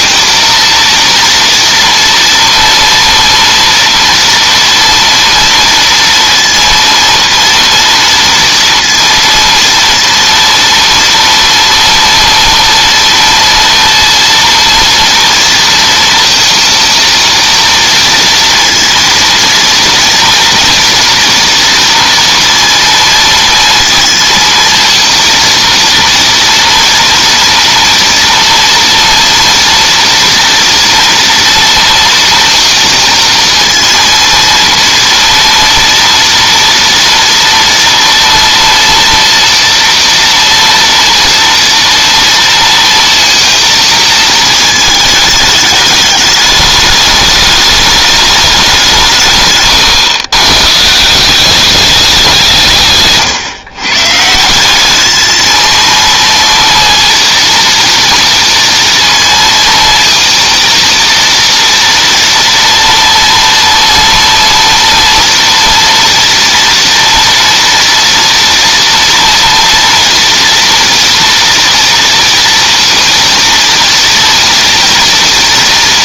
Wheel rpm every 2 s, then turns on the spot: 230, 230, 230, 230, 230, 230, 230, 230, 230, 230, 230, 230, 230, 230, 230, 240, 230, 230, 230, 230, 230, 230, 230, 210, 210, 120, 200, 140, 230, 230, 230, 230, 230, 230, 230, 230, 230, 240.
none